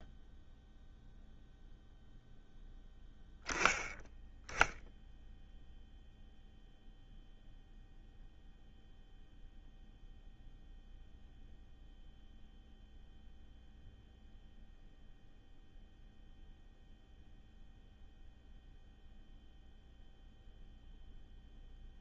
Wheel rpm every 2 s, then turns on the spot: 0, 0, 0, 0, 0, 0, 0, 0, 0, 0, 0.
none